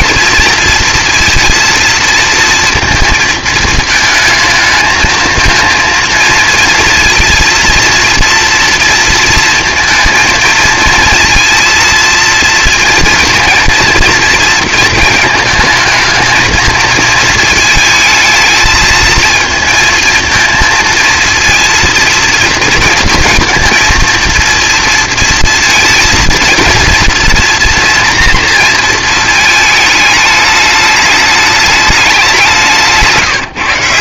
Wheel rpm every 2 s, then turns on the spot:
230, 230, 220, 230, 230, 230, 230, 230, 230, 220, 230, 230, 230, 230, 230, 210, 180.
none